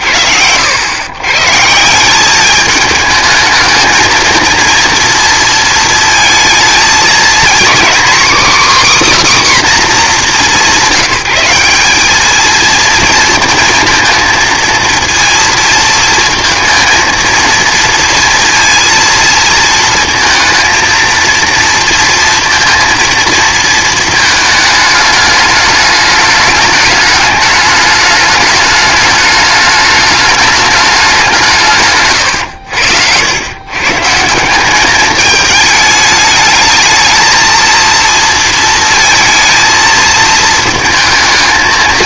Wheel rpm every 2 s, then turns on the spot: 90, 210, 230, 220, 280, 170, 230, 230, 230, 230, 230, 230, 220, 210, 210, 210, 90, 190, 220, 230, 220.
none